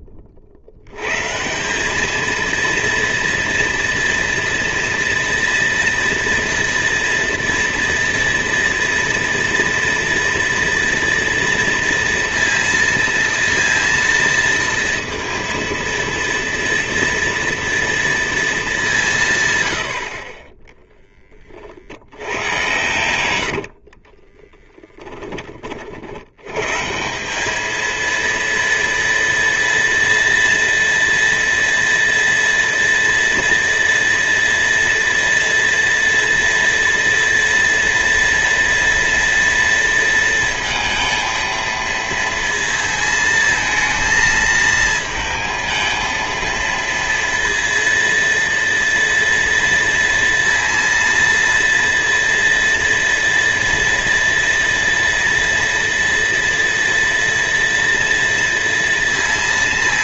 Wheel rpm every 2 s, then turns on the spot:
90, 230, 230, 230, 230, 230, 230, 230, 230, 180, 10, 100, 20, 180, 230, 230, 230, 230, 230, 230, 230, 220, 220, 230, 230, 230, 230, 230, 230, 230.
22-24